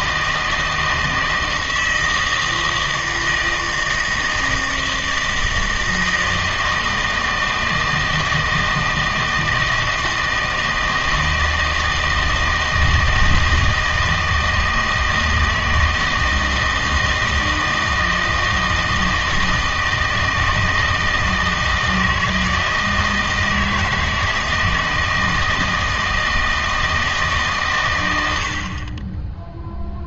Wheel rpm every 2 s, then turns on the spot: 160, 160, 160, 160, 160, 160, 160, 160, 160, 160, 160, 160, 160, 160, 50.
none